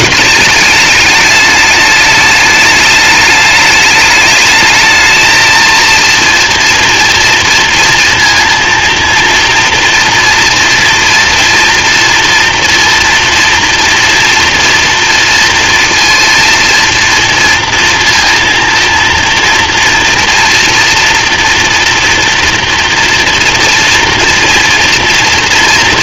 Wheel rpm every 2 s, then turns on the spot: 210, 210, 220, 230, 230, 230, 230, 230, 230, 230, 230, 230, 230.
none